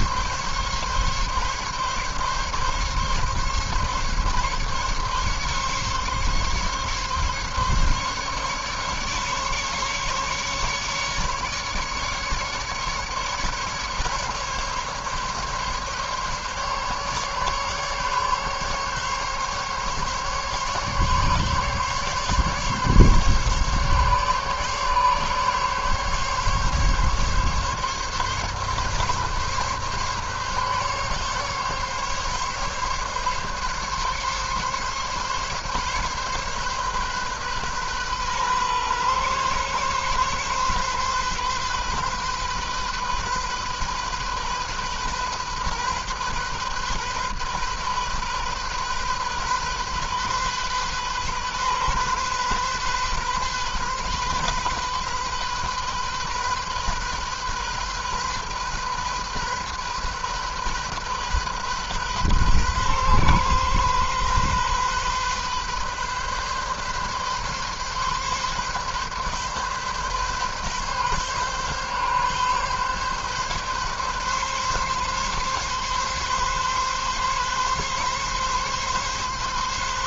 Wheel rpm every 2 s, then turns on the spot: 140, 140, 140, 140, 140, 150, 150, 140, 140, 140, 140, 140, 140, 140, 140, 140, 140, 140, 140, 130, 130, 130, 130, 130, 130, 130, 130, 130, 130, 130, 130, 130, 130, 130, 140, 140, 130, 140, 140, 140.
none